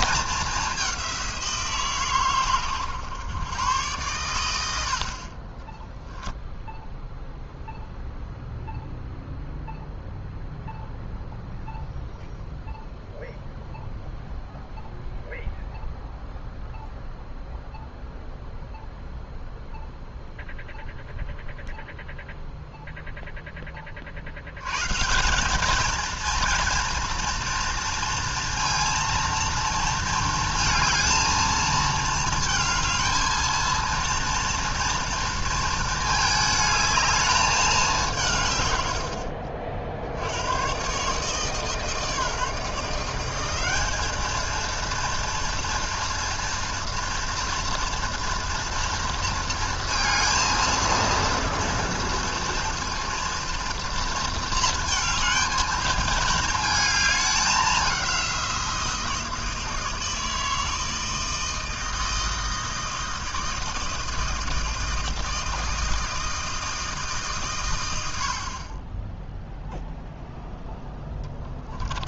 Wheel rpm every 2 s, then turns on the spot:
200, 120, 90, 0, 0, 0, 0, 0, 0, 0, 0, 0, 120, 230, 230, 230, 220, 230, 220, 130, 110, 160, 220, 230, 230, 230, 230, 220, 220, 170, 160, 160, 160, 160, 40, 0.
none